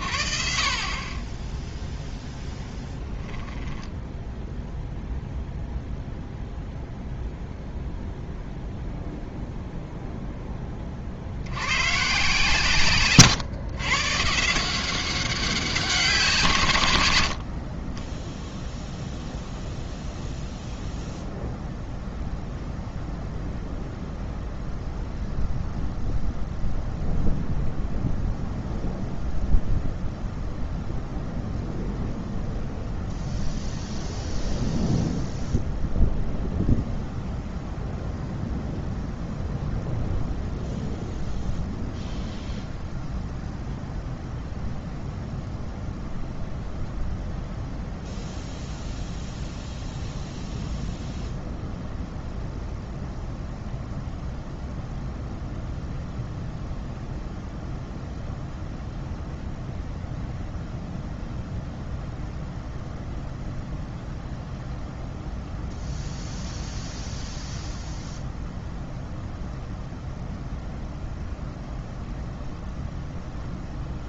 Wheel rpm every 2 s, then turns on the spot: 60, 0, 0, 0, 0, 10, 140, 160, 150, 0, 0, 0, 0, 0, 0, 0, 0, 0, 0, 0, 0, 0, 0, 0, 0, 0, 0, 0, 0, 0, 0, 0, 0, 0, 0, 0, 0.
none